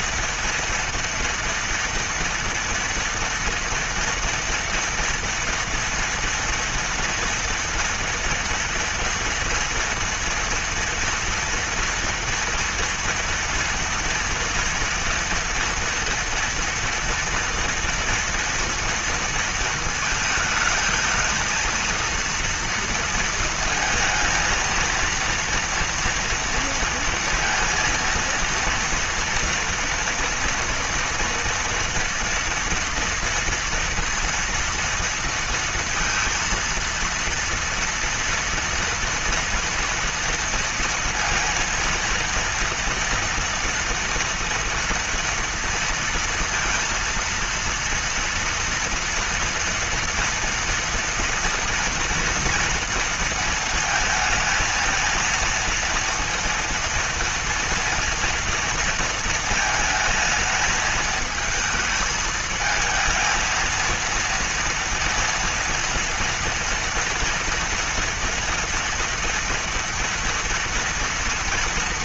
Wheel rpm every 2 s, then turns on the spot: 230, 230, 230, 240, 240, 230, 230, 230, 230, 230, 220, 230, 230, 230, 230, 230, 230, 230, 230, 230, 230, 230, 230, 230, 230, 230, 230, 220, 230, 230, 220, 220, 230, 230, 240, 230.
none